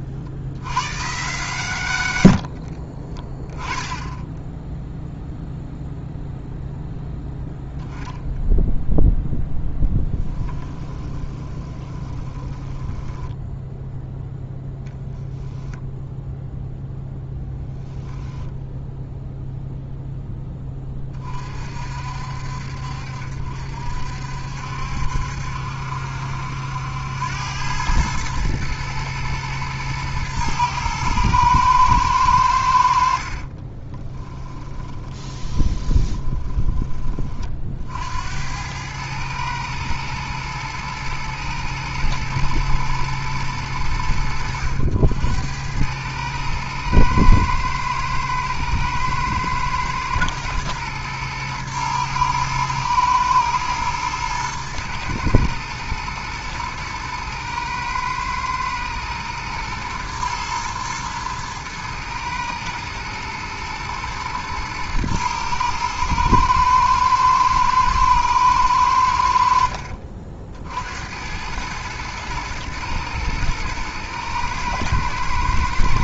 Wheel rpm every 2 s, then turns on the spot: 110, 40, 0, 0, 0, 10, 10, 0, 0, 0, 20, 60, 70, 80, 110, 110, 70, 10, 20, 100, 110, 110, 80, 110, 110, 110, 110, 110, 120, 110, 110, 110, 110, 110, 100, 70, 110, 110.
2-4 10-14 34-36